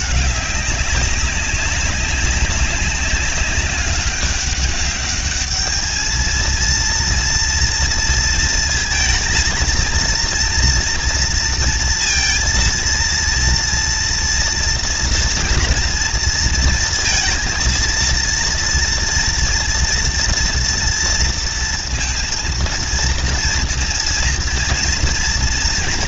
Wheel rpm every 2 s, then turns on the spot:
210, 200, 200, 220, 230, 230, 230, 230, 230, 230, 230, 230, 230.
none